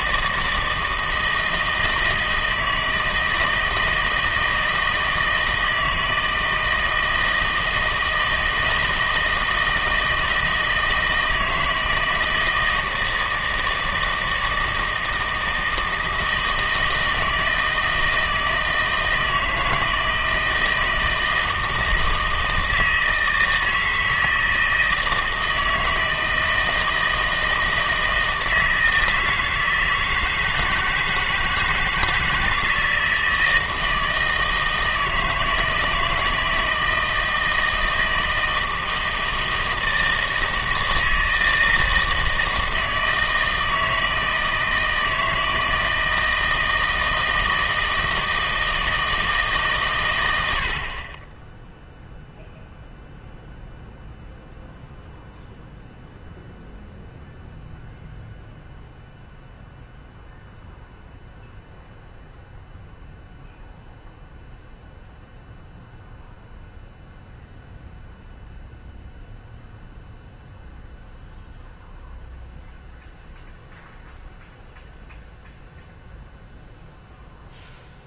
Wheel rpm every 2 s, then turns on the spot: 160, 160, 160, 160, 160, 160, 160, 160, 160, 160, 160, 160, 160, 160, 160, 160, 160, 160, 160, 160, 160, 160, 160, 160, 160, 60, 0, 0, 0, 0, 0, 0, 0, 0, 0, 0, 0, 0, 0.
none